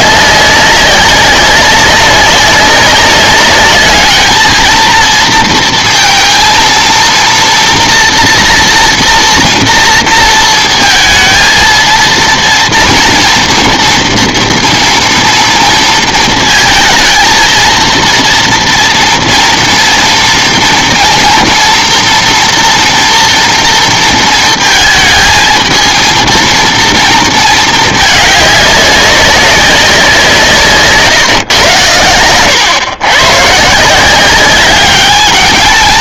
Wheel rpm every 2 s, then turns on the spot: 200, 190, 220, 230, 230, 220, 230, 230, 230, 230, 230, 240, 220, 230, 200, 160, 110, 200.
none